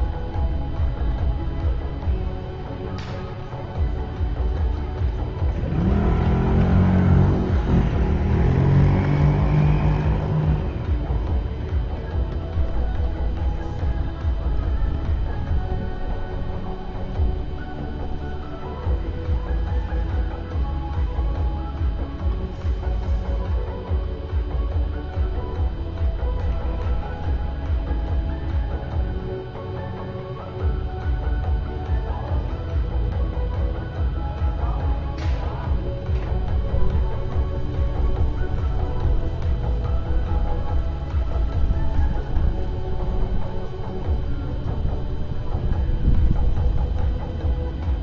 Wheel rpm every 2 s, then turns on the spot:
0, 0, 0, 0, 0, 0, 0, 0, 0, 0, 0, 0, 0, 0, 0, 0, 0, 0, 0, 0, 0, 0, 0, 0.
none